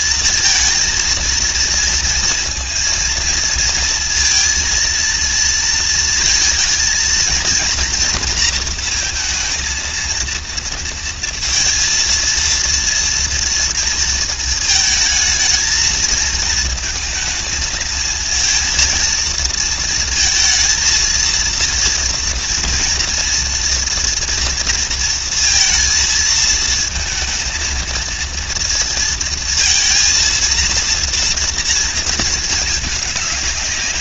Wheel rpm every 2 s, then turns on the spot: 220, 230, 230, 220, 230, 230, 230, 220, 220, 230, 230, 230, 230, 220, 230, 230, 220.
none